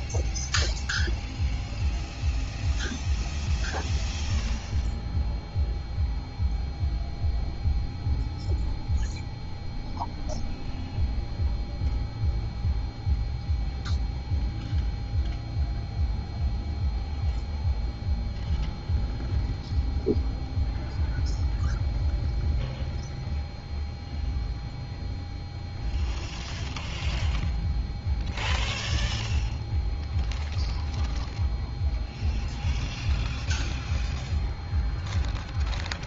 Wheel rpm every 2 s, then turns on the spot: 0, 0, 0, 0, 0, 0, 0, 0, 0, 0, 0, 0, 0, 0, 0, 0, 0, 0.
none